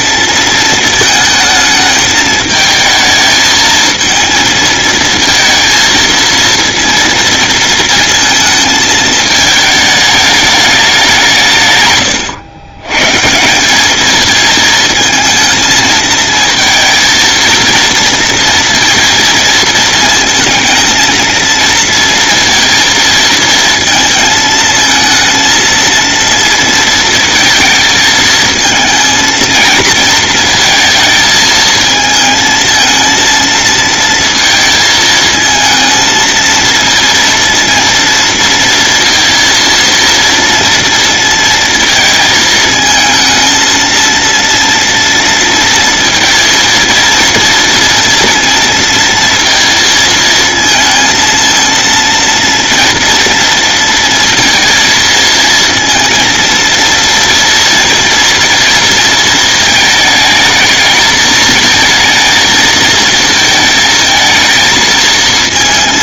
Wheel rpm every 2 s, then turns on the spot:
220, 220, 230, 230, 220, 200, 120, 220, 220, 230, 230, 230, 230, 230, 230, 230, 230, 220, 230, 230, 230, 220, 230, 230, 230, 220, 230, 230, 230, 230, 220, 220, 220.
none